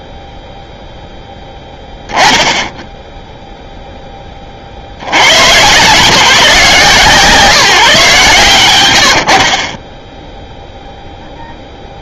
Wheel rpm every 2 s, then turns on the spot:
0, 0, 140, 160, 40, 0.
none